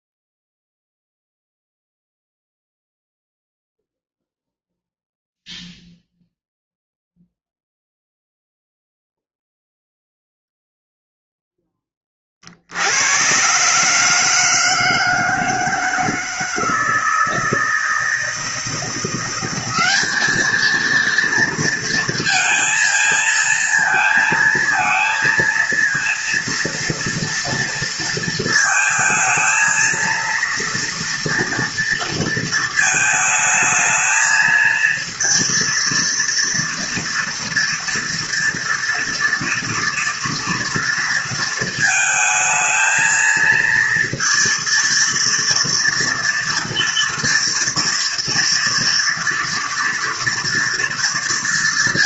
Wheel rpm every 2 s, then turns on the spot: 0, 0, 0, 0, 0, 0, 70, 160, 160, 160, 220, 230, 230, 230, 230, 230, 230, 230, 230, 230, 230, 220, 230, 230, 230, 230.
none